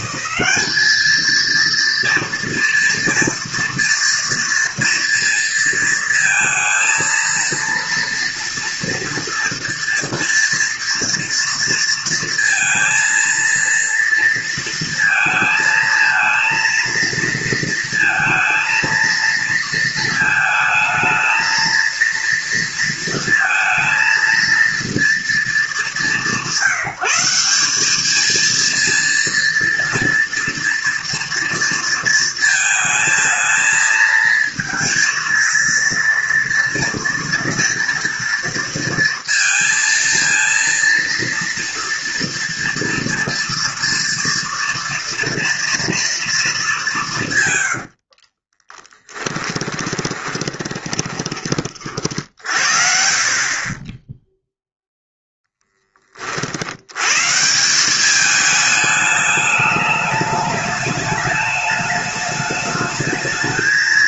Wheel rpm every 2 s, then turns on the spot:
200, 230, 230, 230, 230, 240, 230, 230, 230, 230, 220, 230, 230, 180, 220, 230, 220, 230, 230, 230, 230, 240, 240, 220, 40, 20, 50, 0, 70, 210, 210, 210.
48-52